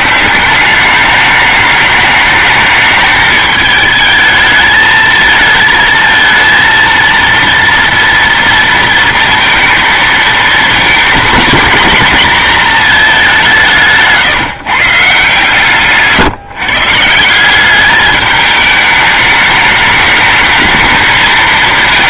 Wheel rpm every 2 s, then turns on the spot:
190, 220, 220, 230, 230, 220, 230, 140, 140, 210, 220.
none